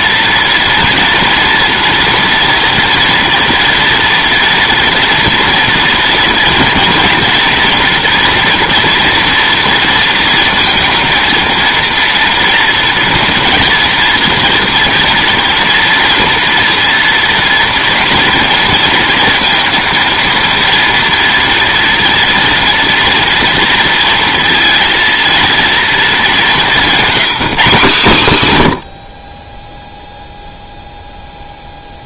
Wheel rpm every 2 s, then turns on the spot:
240, 230, 230, 240, 240, 230, 230, 230, 230, 230, 230, 230, 230, 200, 120, 0.
none